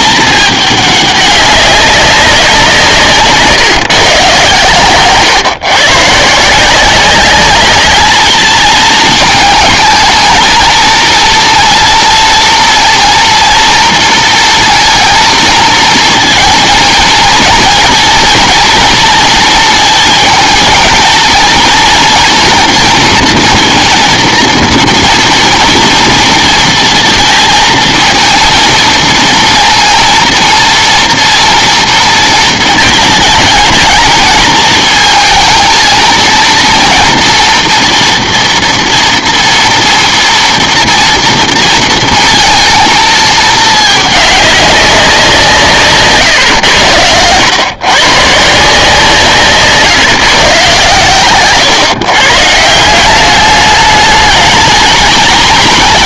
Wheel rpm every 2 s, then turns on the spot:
210, 180, 130, 170, 220, 230, 230, 230, 230, 230, 220, 230, 230, 230, 230, 230, 220, 220, 230, 230, 230, 230, 200, 120, 170, 130, 150, 220.
none